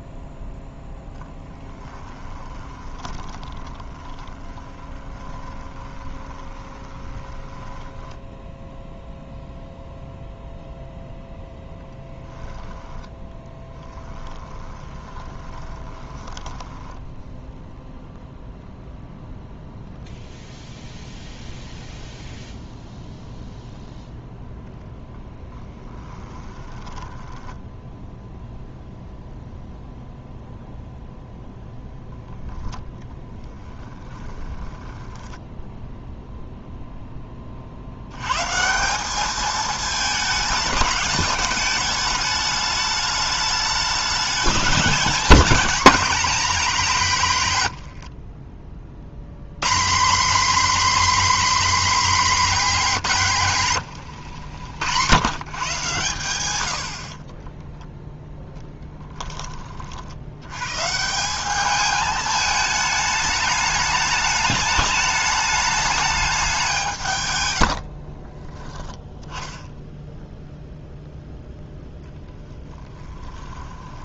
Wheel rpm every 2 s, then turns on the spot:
0, 20, 20, 20, 10, 0, 10, 20, 10, 0, 0, 0, 0, 10, 0, 0, 10, 10, 0, 170, 210, 210, 210, 190, 50, 280, 220, 100, 70, 10, 140, 210, 210, 180, 10, 0, 20.
2-8 12-18 26-28 34-36 72-74